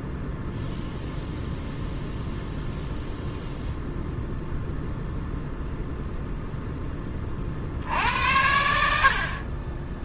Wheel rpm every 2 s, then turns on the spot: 0, 0, 0, 10, 90.
none